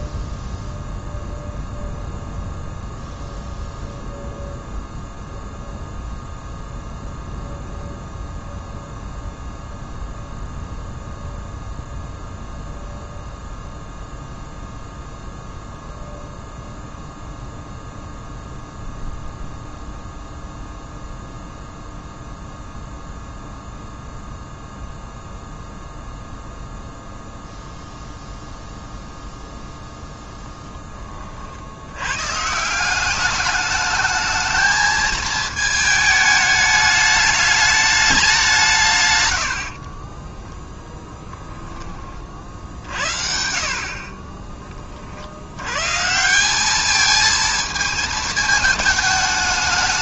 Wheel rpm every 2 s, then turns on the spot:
0, 0, 0, 0, 0, 0, 0, 0, 0, 0, 0, 0, 0, 0, 0, 10, 170, 220, 210, 180, 0, 60, 30, 210, 210.
none